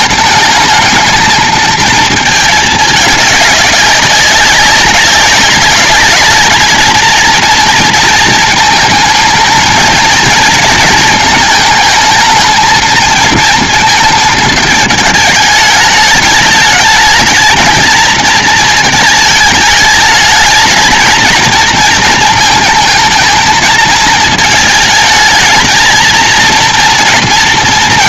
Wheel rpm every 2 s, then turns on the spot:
220, 210, 190, 220, 220, 220, 220, 220, 210, 220, 220, 220, 220, 230.
none